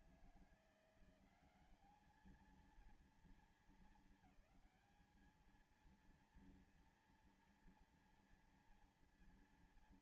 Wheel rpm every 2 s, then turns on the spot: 170, 220, 210, 230, 230.
none